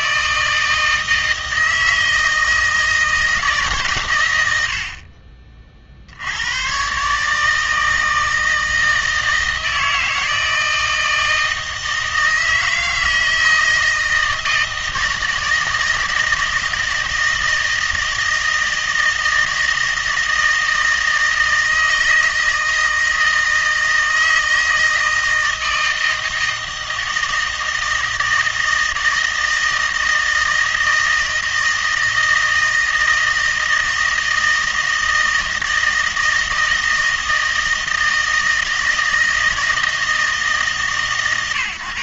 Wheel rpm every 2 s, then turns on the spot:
160, 160, 80, 110, 160, 160, 160, 160, 160, 160, 160, 160, 160, 160, 160, 160, 160, 160, 160, 160, 150.
none